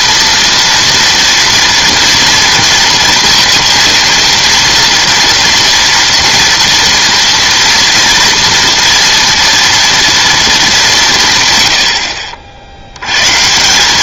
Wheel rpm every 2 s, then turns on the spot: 230, 230, 230, 240, 230, 210, 70.
none